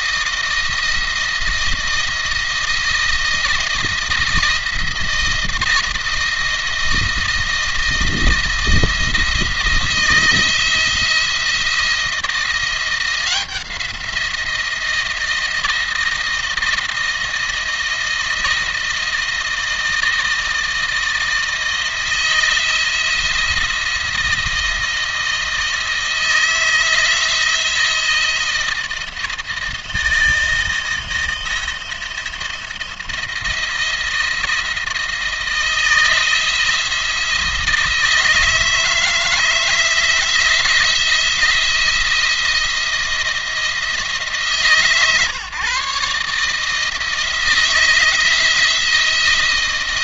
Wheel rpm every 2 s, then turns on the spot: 160, 160, 160, 170, 160, 160, 170, 170, 160, 160, 160, 170, 170, 160, 170, 160, 170, 170, 170, 160, 160, 170, 140, 160, 170.
none